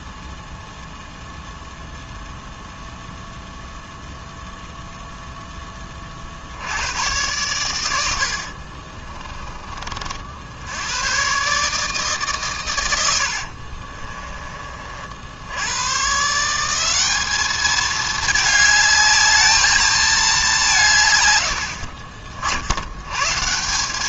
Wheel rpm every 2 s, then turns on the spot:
0, 0, 0, 110, 50, 100, 90, 50, 190, 210, 150, 90.
8-10